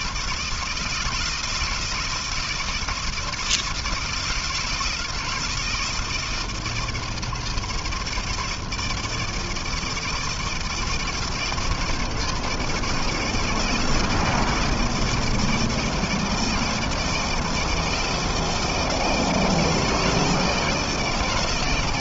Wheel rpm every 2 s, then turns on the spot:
160, 160, 160, 160, 160, 160, 160, 160, 160, 160, 170.
none